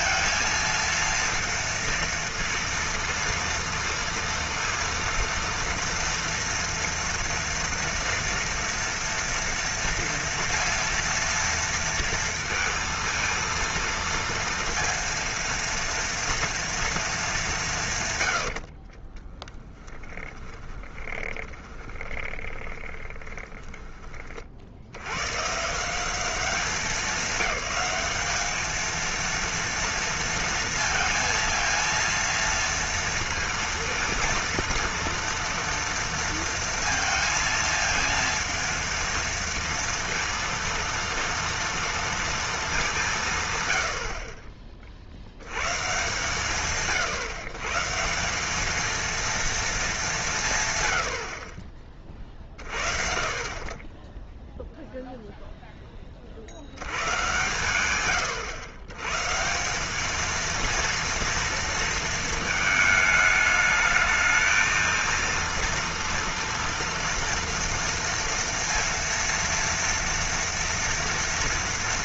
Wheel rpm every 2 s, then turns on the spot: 230, 230, 230, 230, 230, 230, 230, 230, 230, 70, 20, 20, 40, 190, 210, 230, 230, 230, 230, 230, 230, 220, 40, 140, 210, 150, 40, 0, 60, 110, 230, 220, 220, 230, 230, 230.
18-24